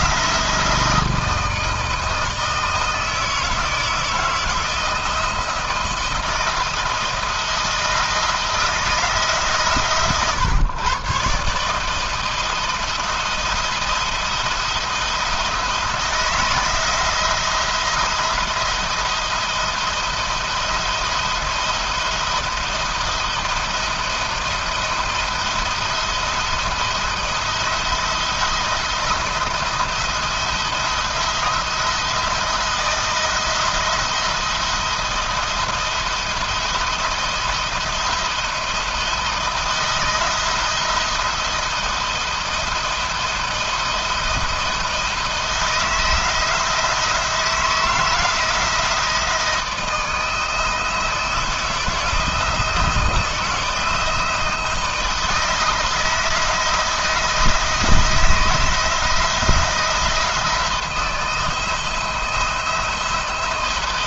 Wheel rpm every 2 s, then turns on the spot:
170, 160, 160, 160, 160, 130, 170, 170, 170, 170, 160, 170, 170, 170, 170, 170, 160, 170, 170, 160, 170, 170, 170, 170, 170, 160, 160, 160, 160, 170, 160, 170.
none